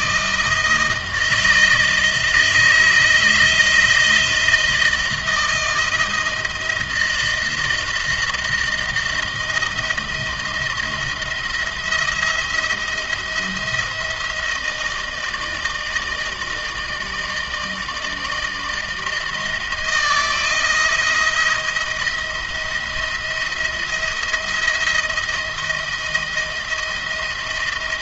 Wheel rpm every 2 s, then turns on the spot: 160, 160, 170, 160, 160, 160, 170, 160, 160, 160, 170, 170, 170, 170.
none